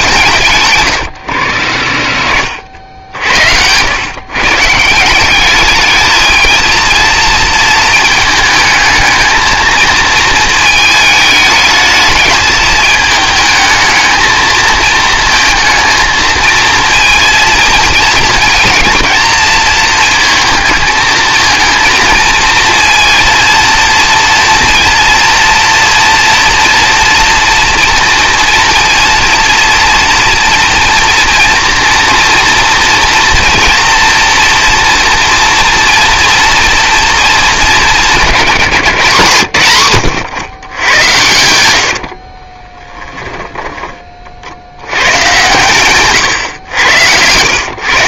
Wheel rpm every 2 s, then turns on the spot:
130, 60, 150, 230, 220, 220, 220, 220, 230, 230, 220, 230, 230, 230, 230, 230, 240, 230, 230, 180, 120, 30, 80, 110.
42-44